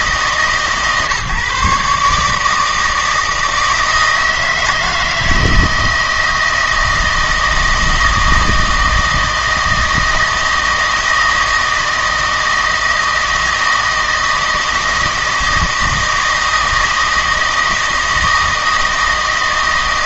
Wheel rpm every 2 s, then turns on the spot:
150, 160, 160, 160, 160, 160, 160, 160, 160, 160.
none